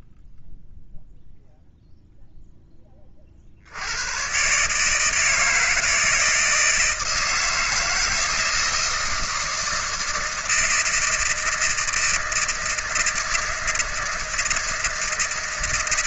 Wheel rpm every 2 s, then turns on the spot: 0, 10, 140, 160, 160, 160, 160, 160.
none